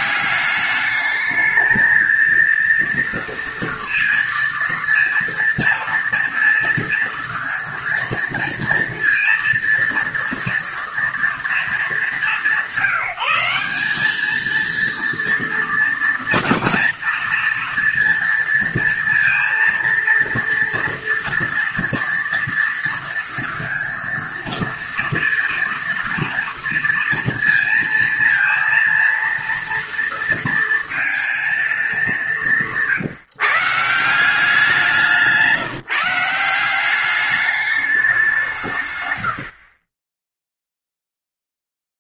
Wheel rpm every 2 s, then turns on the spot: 200, 230, 230, 230, 230, 230, 190, 220, 230, 230, 230, 230, 230, 230, 230, 230, 170, 180, 180, 160, 0.
32-34